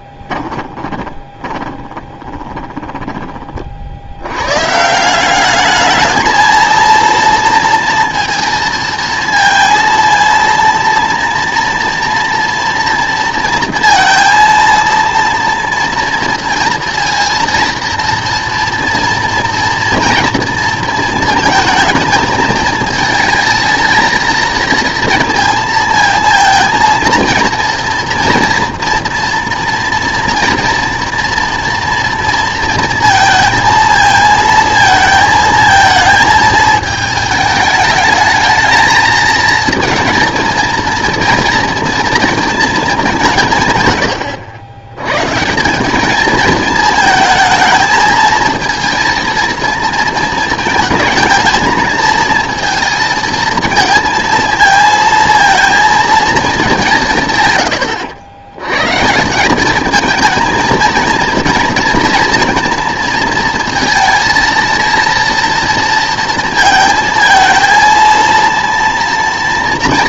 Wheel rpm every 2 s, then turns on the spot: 20, 20, 150, 230, 230, 230, 230, 230, 230, 230, 230, 220, 230, 230, 230, 230, 230, 230, 220, 220, 230, 220, 100, 220, 230, 220, 230, 220, 190, 120, 230, 230, 230, 220, 230.
0-4